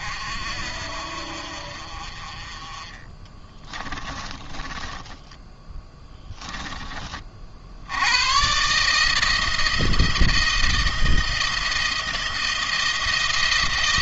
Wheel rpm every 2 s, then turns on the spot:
50, 30, 20, 10, 130, 170, 170.
4-6